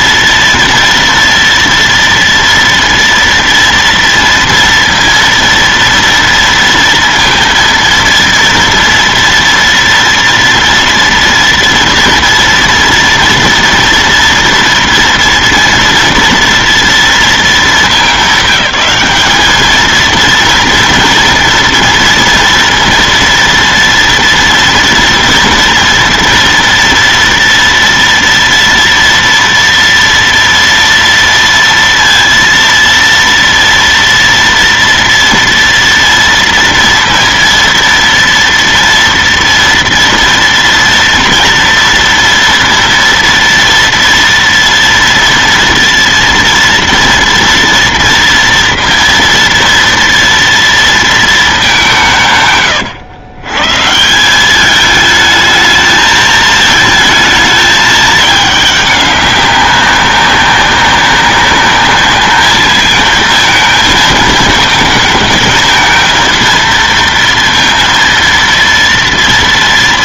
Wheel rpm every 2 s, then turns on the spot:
230, 240, 230, 230, 230, 230, 240, 240, 230, 190, 230, 230, 230, 230, 230, 230, 230, 230, 230, 230, 230, 230, 230, 230, 230, 230, 120, 210, 220, 200, 200, 220, 220, 230, 230.
none